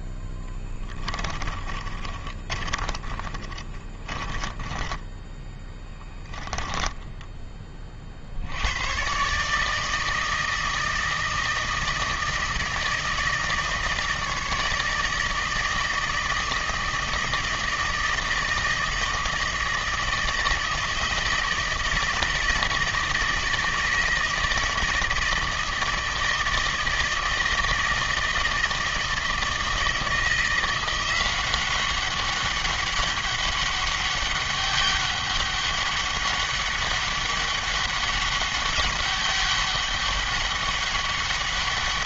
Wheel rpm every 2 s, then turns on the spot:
20, 30, 20, 10, 100, 160, 160, 160, 160, 160, 160, 160, 160, 160, 160, 170, 200, 200, 200, 200, 200.
0-8